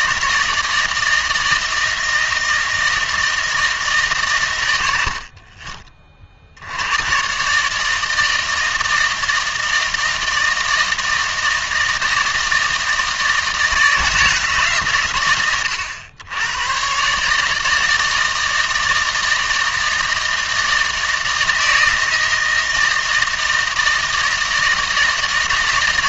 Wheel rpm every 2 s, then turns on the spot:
160, 160, 90, 90, 160, 160, 160, 130, 120, 160, 160, 160, 160.
none